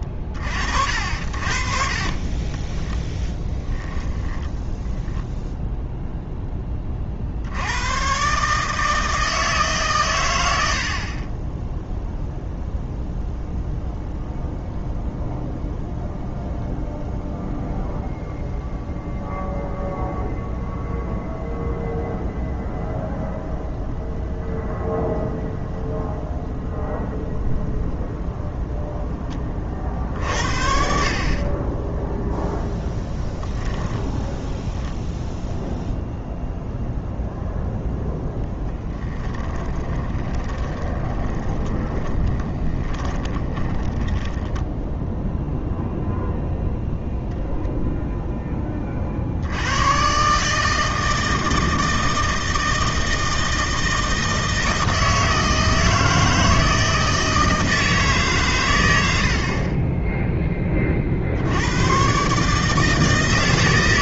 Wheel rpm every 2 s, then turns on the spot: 50, 20, 10, 20, 150, 70, 0, 0, 0, 0, 0, 0, 0, 0, 10, 50, 0, 0, 0, 0, 20, 20, 10, 0, 20, 150, 160, 160, 160, 110, 20, 150.
2-6 40-44